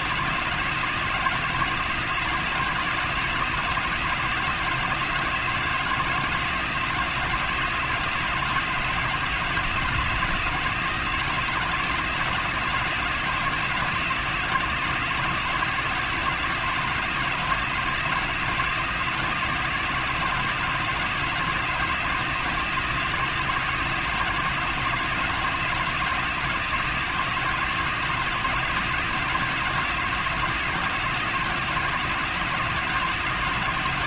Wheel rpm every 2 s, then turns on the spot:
170, 170, 170, 170, 170, 170, 170, 170, 170, 170, 170, 170, 170, 170, 170, 170, 170.
none